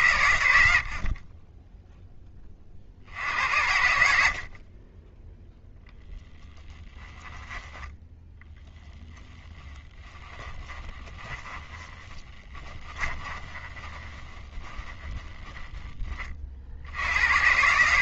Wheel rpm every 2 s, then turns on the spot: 80, 40, 40, 10, 10, 20, 20, 10, 40.
4-6 8-16